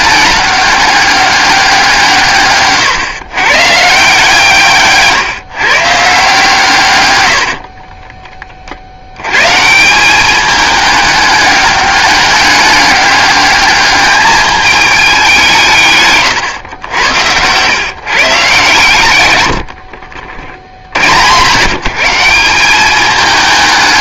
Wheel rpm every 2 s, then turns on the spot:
200, 130, 150, 140, 60, 210, 200, 210, 100, 120, 60, 190.
18-20